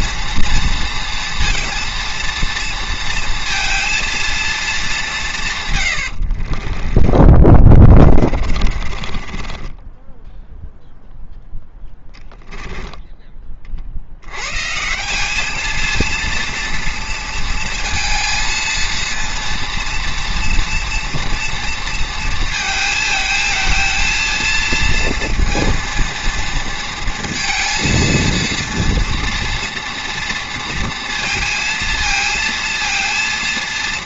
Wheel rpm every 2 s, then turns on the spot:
240, 230, 220, 40, 30, 0, 10, 140, 230, 230, 230, 220, 230, 230, 230, 230, 230.
6-10 12-14